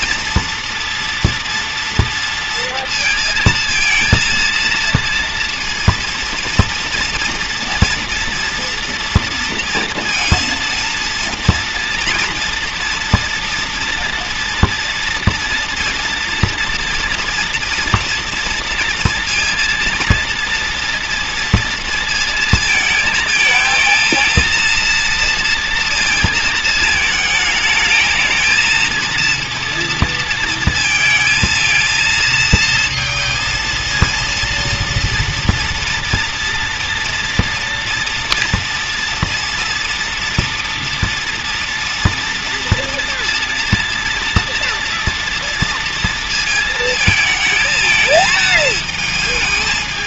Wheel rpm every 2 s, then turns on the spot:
230, 230, 230, 230, 230, 230, 230, 230, 240, 230, 230, 230, 230, 220, 220, 230, 230, 230, 240, 230, 230, 230, 230, 220, 230.
none